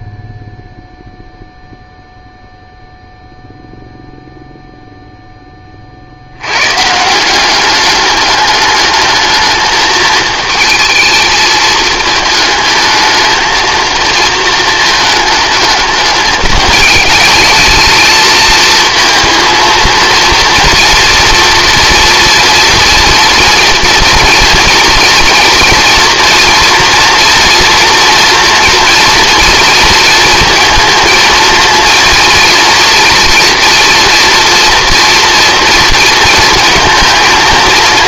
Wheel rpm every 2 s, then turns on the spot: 0, 0, 0, 120, 210, 220, 220, 220, 210, 220, 230, 240, 230, 230, 230, 230, 230, 230, 230.
none